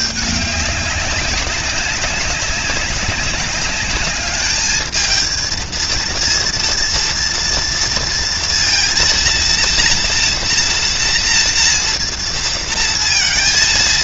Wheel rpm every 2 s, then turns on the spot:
200, 200, 220, 230, 230, 230, 230.
none